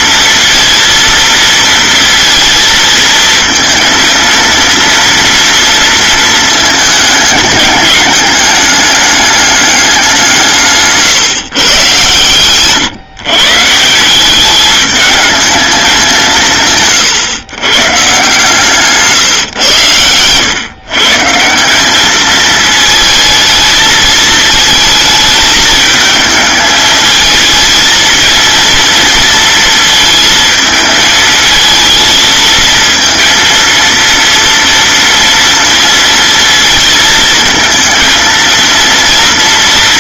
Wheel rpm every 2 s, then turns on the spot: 230, 230, 230, 220, 210, 140, 130, 210, 140, 150, 140, 220, 220, 220, 230, 220, 230, 230, 220, 230.
none